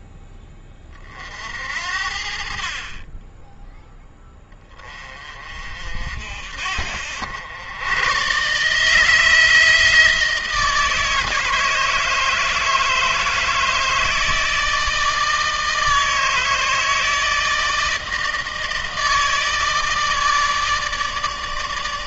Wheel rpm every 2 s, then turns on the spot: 30, 40, 20, 60, 150, 160, 160, 160, 160, 160, 160.
none